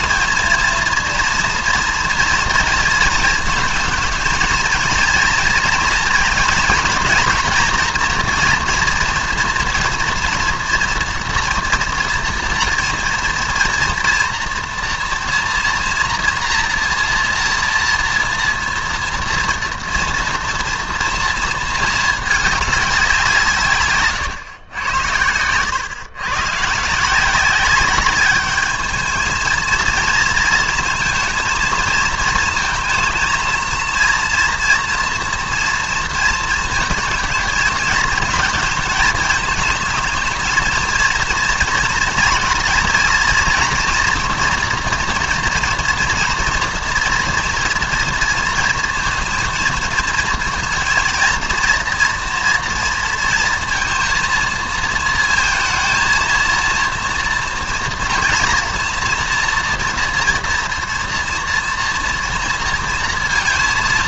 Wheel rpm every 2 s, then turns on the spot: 230, 230, 230, 230, 230, 230, 230, 230, 240, 230, 240, 210, 110, 130, 210, 230, 230, 230, 220, 220, 230, 230, 230, 230, 230, 230, 230, 230, 230, 240, 230, 230.
none